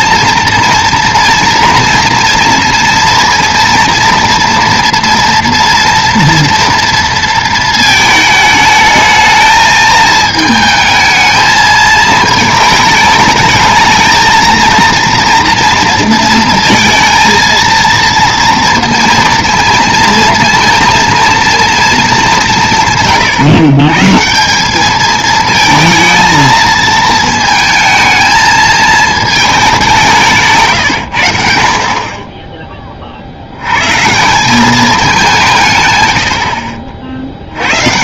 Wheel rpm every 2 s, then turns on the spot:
230, 230, 230, 230, 220, 220, 220, 230, 220, 230, 230, 170, 200, 220, 220, 140, 20, 200, 40.
none